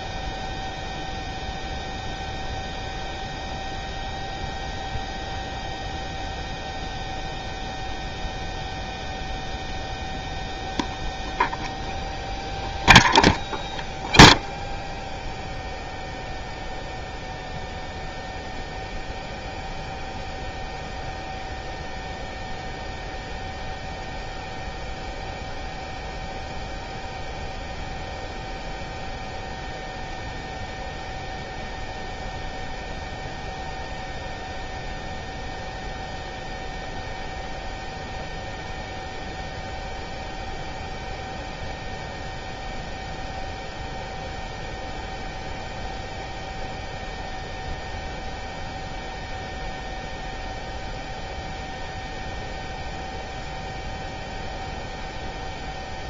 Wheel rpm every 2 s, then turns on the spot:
0, 0, 0, 0, 0, 0, 0, 0, 0, 0, 0, 0, 0, 0, 0, 0, 0, 0, 0, 0, 0, 0, 0, 0, 0, 0, 0, 0.
none